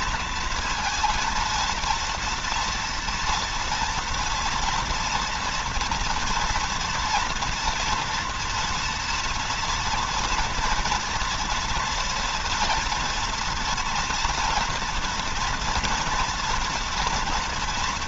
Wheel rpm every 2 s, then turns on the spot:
230, 230, 230, 230, 230, 240, 230, 230, 240.
none